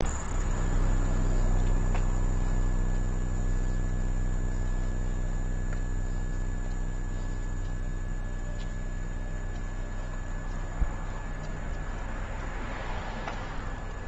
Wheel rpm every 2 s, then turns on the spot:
0, 0, 0, 0, 0, 0, 0.
none